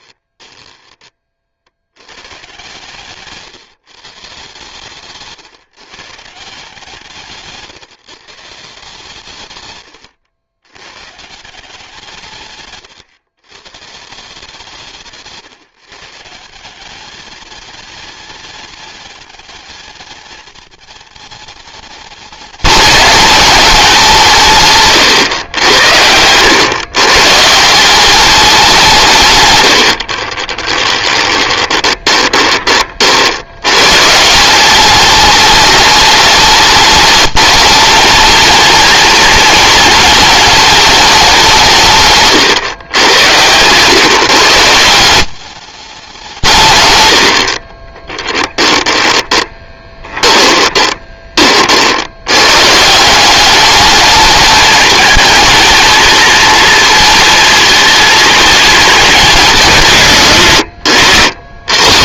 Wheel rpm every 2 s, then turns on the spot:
20, 140, 140, 150, 150, 110, 130, 160, 180, 210, 220, 220, 140, 110, 190, 20, 30, 190, 210, 230, 220, 120, 150, 130, 20, 20, 140, 220, 230, 220, 110.
0-2 24-26 30-32 48-52